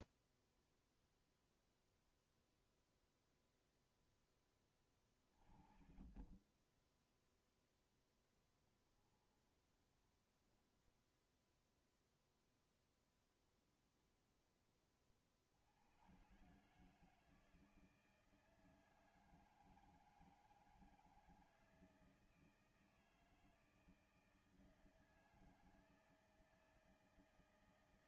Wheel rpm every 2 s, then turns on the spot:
0, 0, 10, 20, 10, 10, 0, 20, 130, 160, 160, 160, 160, 160.
8-10